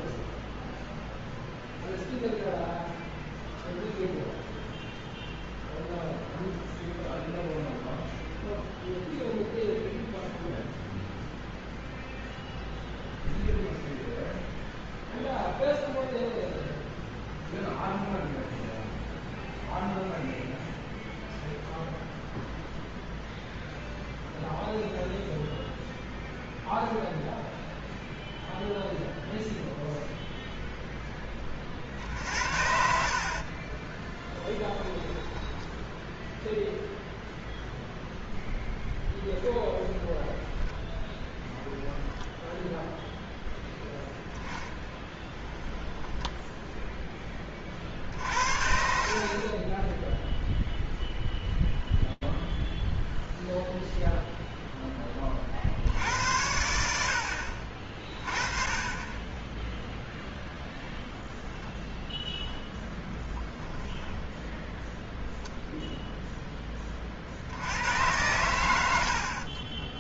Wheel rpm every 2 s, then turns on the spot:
0, 0, 0, 0, 0, 0, 0, 0, 0, 0, 0, 0, 0, 0, 0, 0, 60, 10, 0, 0, 0, 0, 10, 0, 50, 0, 0, 10, 70, 30, 10, 10, 0, 10, 100.
34-36 44-46 62-64